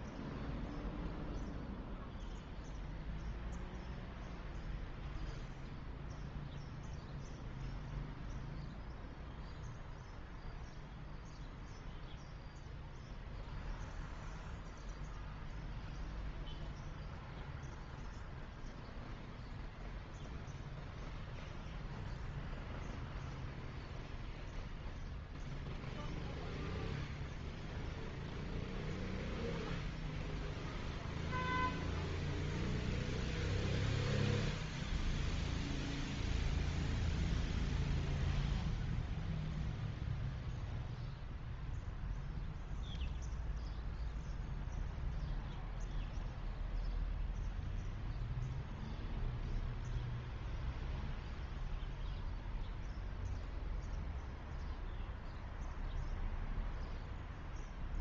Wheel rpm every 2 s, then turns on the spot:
0, 0, 0, 0, 0, 0, 0, 0, 0, 0, 0, 0, 0, 0, 0, 0, 0, 0, 0, 0, 0, 0, 0, 0, 0, 0, 0, 0, 0.
none